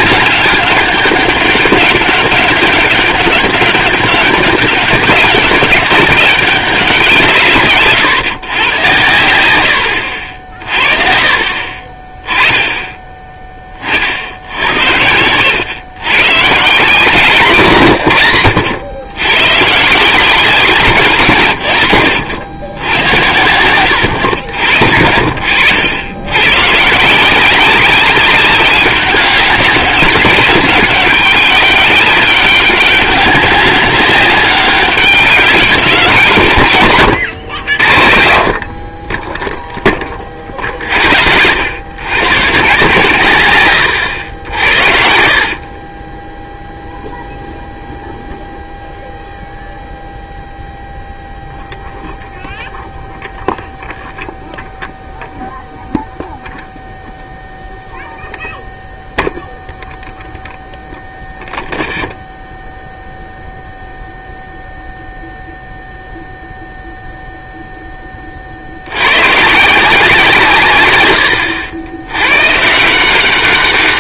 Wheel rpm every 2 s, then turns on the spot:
200, 200, 190, 190, 110, 40, 10, 70, 150, 100, 170, 80, 50, 130, 200, 200, 200, 200, 130, 50, 50, 130, 60, 0, 0, 0, 0, 0, 0, 0, 0, 0, 0, 0, 70, 130, 150.
none